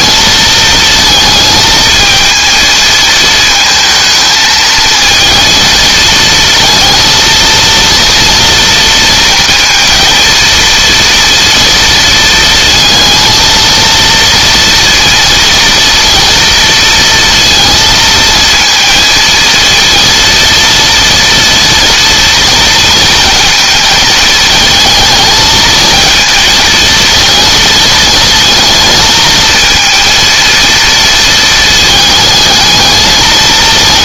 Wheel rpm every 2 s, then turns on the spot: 230, 230, 220, 230, 230, 230, 230, 230, 230, 220, 230, 230, 230, 230, 220, 230, 220.
none